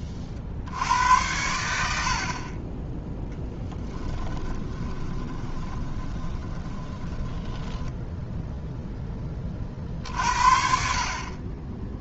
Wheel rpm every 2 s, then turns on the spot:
50, 20, 20, 20, 0, 40.
4-8